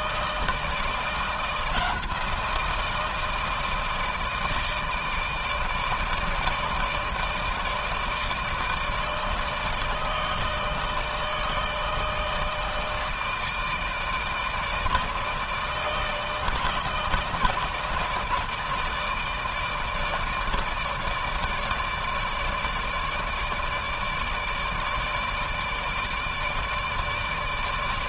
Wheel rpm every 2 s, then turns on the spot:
160, 170, 160, 160, 160, 160, 160, 160, 160, 160, 160, 150, 160, 150.
none